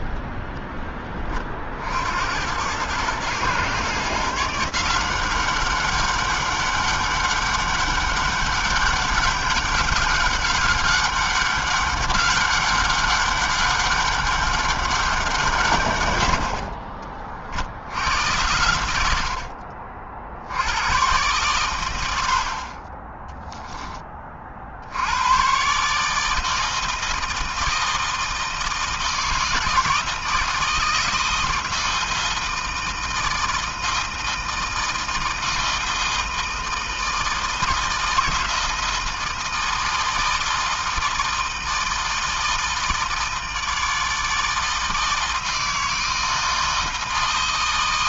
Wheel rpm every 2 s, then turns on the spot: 0, 70, 140, 200, 200, 200, 200, 200, 80, 90, 50, 80, 30, 160, 160, 160, 160, 160, 160, 160, 160, 160, 160, 160.
none